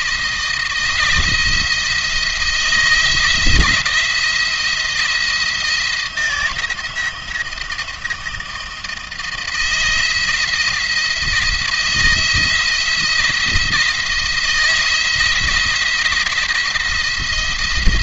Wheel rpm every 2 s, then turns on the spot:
160, 160, 170, 170, 160, 170, 170, 170, 160.
none